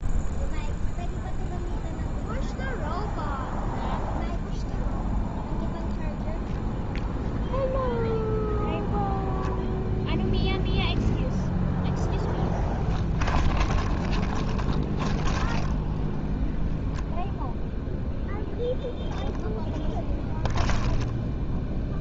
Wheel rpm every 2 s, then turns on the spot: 0, 0, 0, 0, 0, 0, 10, 20, 0, 0, 10.
12-16 20-22